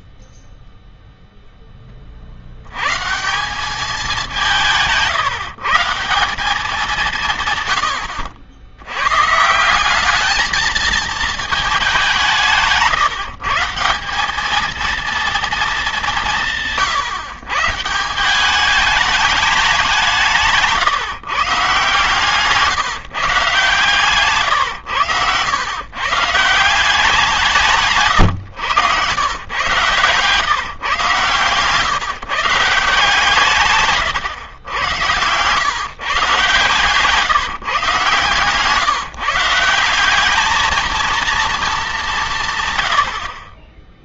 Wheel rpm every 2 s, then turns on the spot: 0, 100, 170, 170, 90, 220, 160, 220, 150, 200, 160, 140, 120, 170, 110, 140, 170, 110, 140, 130, 210, 110.
none